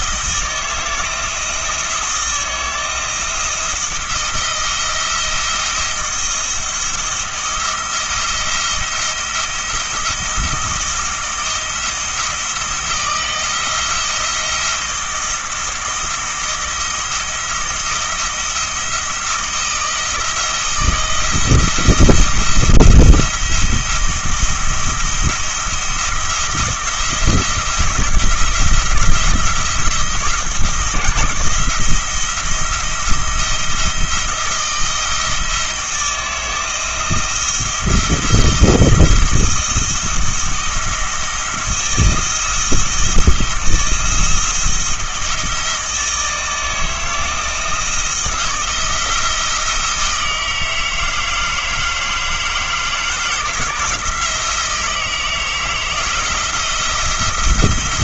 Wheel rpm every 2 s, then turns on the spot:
160, 170, 170, 170, 170, 170, 160, 170, 170, 170, 160, 170, 170, 170, 170, 160, 170, 160, 170, 170, 170, 170, 170, 160, 170, 160, 160, 160, 170.
none